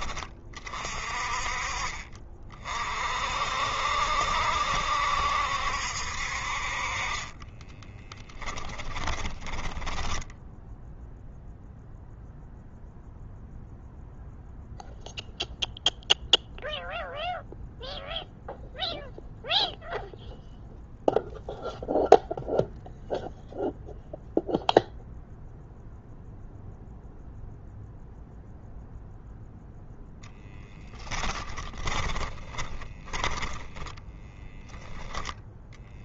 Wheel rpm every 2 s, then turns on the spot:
30, 50, 70, 30, 20, 0, 0, 0, 0, 0, 0, 0, 0, 0, 0, 10, 10, 10.
6-10 32-34